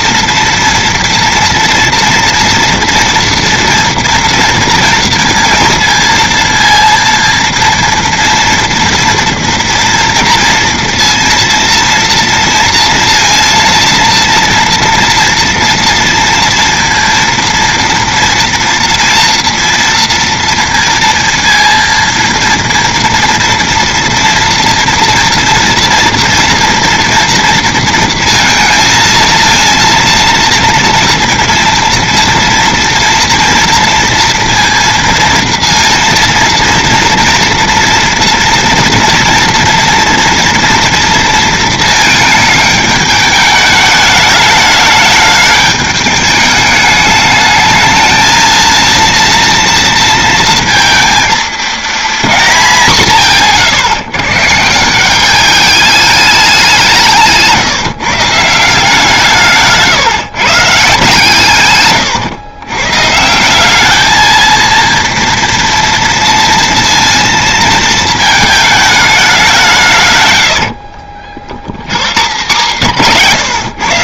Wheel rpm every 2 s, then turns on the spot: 230, 230, 230, 230, 230, 230, 230, 230, 230, 230, 230, 230, 230, 230, 220, 230, 230, 230, 230, 230, 230, 210, 210, 210, 230, 230, 180, 160, 180, 160, 140, 120, 230, 230, 210, 60, 150.
70-72